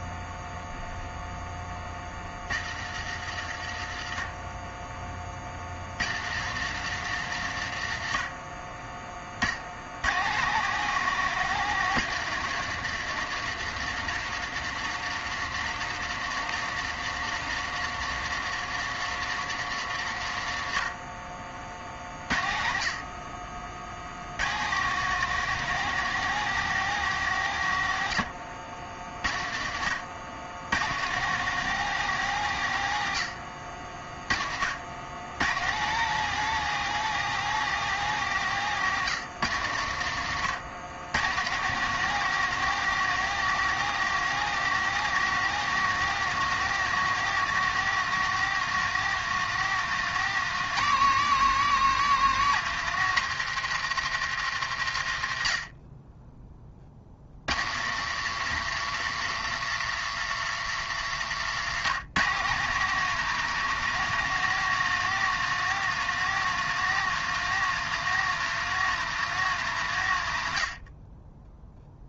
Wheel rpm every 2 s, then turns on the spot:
0, 60, 30, 130, 20, 160, 160, 160, 160, 150, 50, 50, 150, 160, 60, 130, 90, 90, 170, 130, 110, 170, 170, 170, 170, 170, 150, 80, 50, 140, 120, 160, 170, 170, 170, 30.
60-62